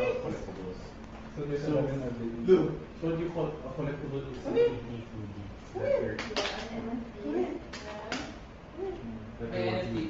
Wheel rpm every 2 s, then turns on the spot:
0, 0, 0, 0, 0.
none